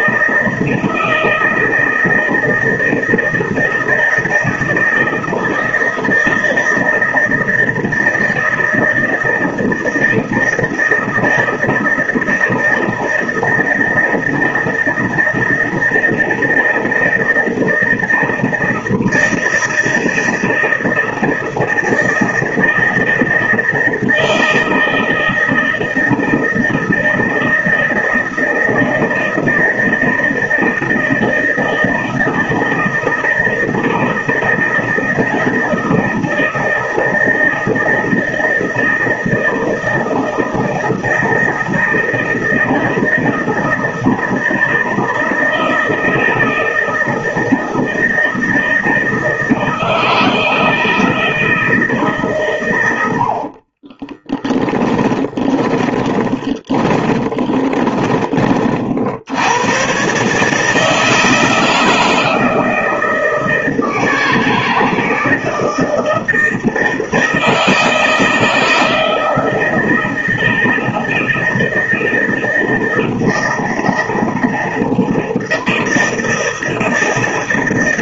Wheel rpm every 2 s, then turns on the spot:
160, 160, 160, 160, 160, 160, 160, 160, 160, 160, 160, 160, 160, 160, 160, 160, 160, 170, 160, 160, 160, 160, 160, 160, 160, 160, 120, 20, 20, 40, 150, 160, 160, 160, 160, 160, 160, 160, 160.
54-58